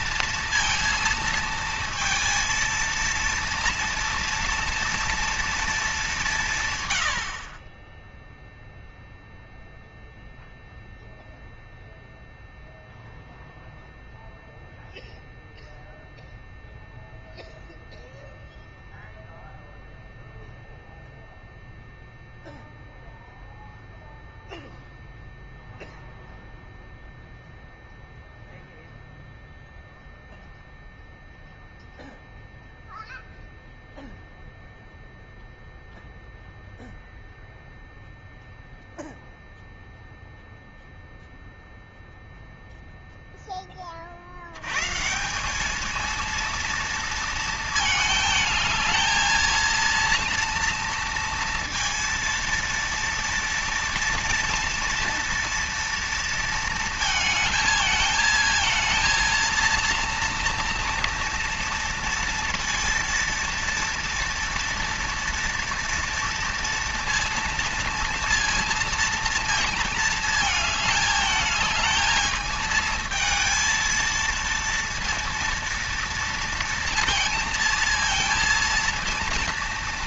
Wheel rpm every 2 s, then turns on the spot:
230, 230, 230, 130, 0, 0, 0, 0, 0, 0, 0, 0, 0, 0, 0, 0, 0, 0, 0, 0, 0, 0, 120, 230, 220, 230, 230, 230, 220, 230, 230, 230, 230, 230, 230, 220, 220, 230, 230, 230.
none